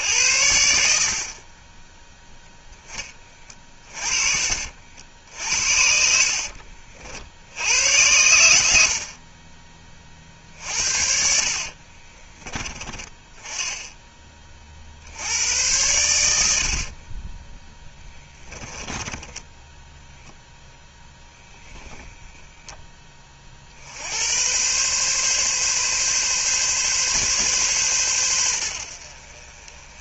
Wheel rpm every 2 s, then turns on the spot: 70, 10, 50, 60, 90, 50, 20, 40, 60, 10, 0, 10, 110, 140, 90.
6-8 10-12 16-20